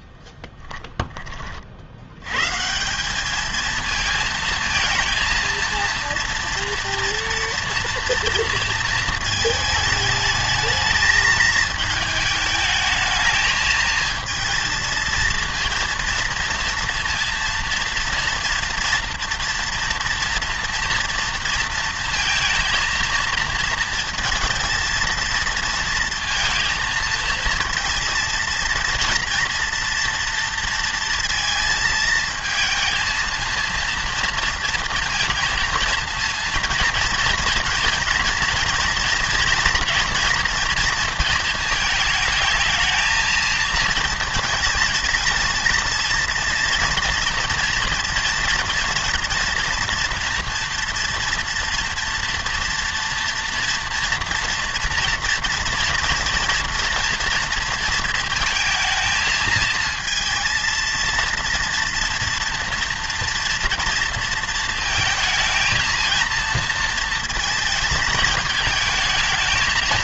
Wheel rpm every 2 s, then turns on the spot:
10, 150, 230, 230, 230, 220, 220, 230, 230, 230, 230, 230, 230, 220, 230, 230, 220, 230, 230, 230, 230, 220, 230, 230, 230, 230, 230, 240, 230, 220, 230, 230, 230, 230, 220.
none